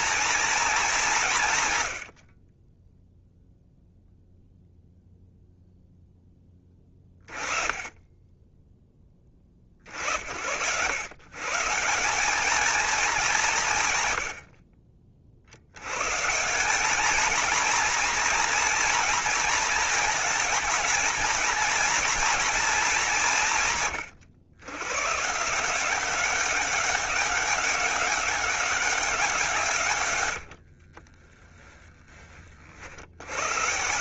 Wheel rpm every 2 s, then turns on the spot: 200, 10, 0, 20, 10, 100, 210, 50, 200, 240, 220, 230, 120, 190, 200, 60, 60.
30-32